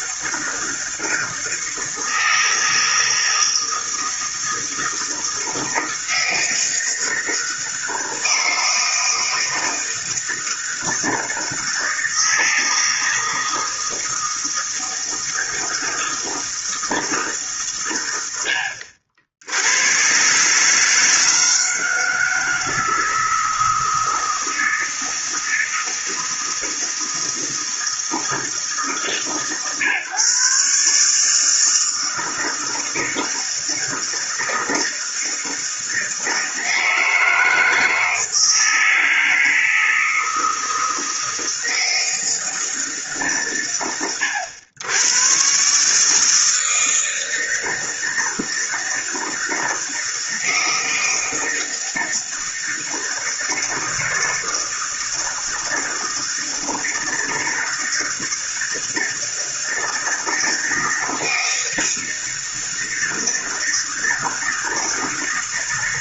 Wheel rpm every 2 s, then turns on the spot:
160, 160, 160, 160, 160, 160, 160, 160, 160, 70, 140, 160, 160, 160, 160, 140, 160, 160, 160, 160, 160, 160, 110, 160, 160, 160, 160, 160, 160, 160, 160, 160, 160.
none